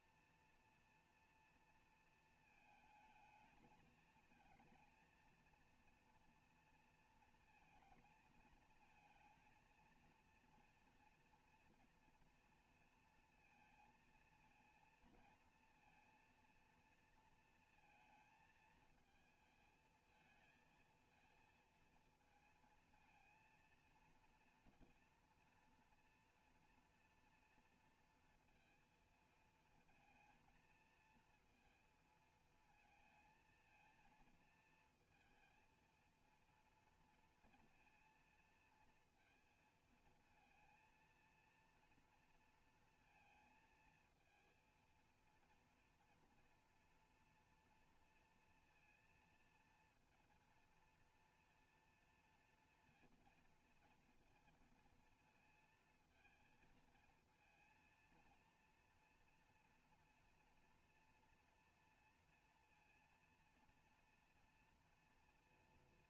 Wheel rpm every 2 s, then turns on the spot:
230, 230, 230, 230, 220, 230, 240, 230, 230, 220, 220, 230, 230, 230, 230, 230, 230, 220, 230, 230, 230, 230, 230, 230, 230, 230, 230, 230, 230, 230, 230, 230, 230.
none